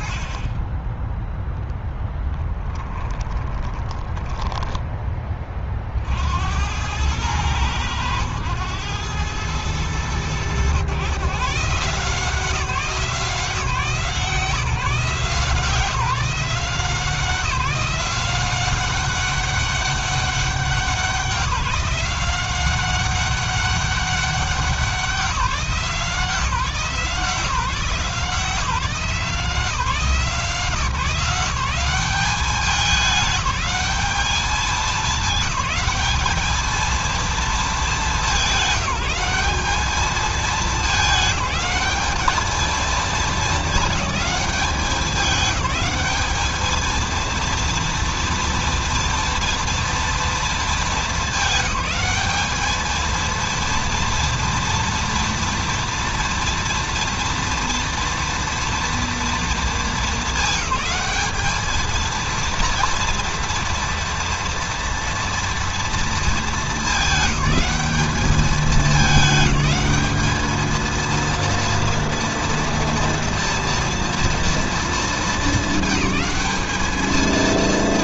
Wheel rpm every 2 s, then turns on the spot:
20, 10, 10, 80, 110, 100, 160, 170, 180, 190, 190, 190, 190, 170, 160, 160, 200, 200, 220, 190, 210, 220, 210, 220, 230, 230, 220, 230, 230, 230, 210, 230, 230, 210, 210, 220, 230, 230, 210.
2-6